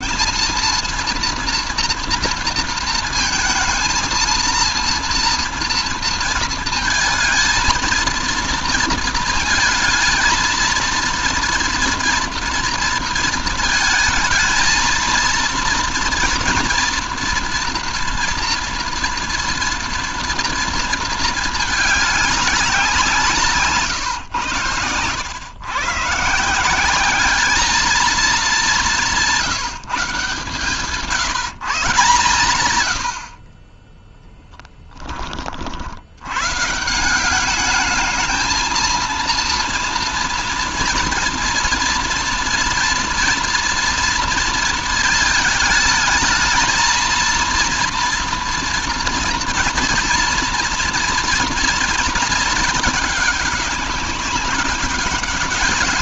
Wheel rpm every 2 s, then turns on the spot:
230, 230, 230, 230, 230, 230, 230, 230, 230, 230, 220, 170, 120, 200, 180, 160, 60, 20, 180, 230, 230, 230, 220, 230, 240, 230, 210, 200.
none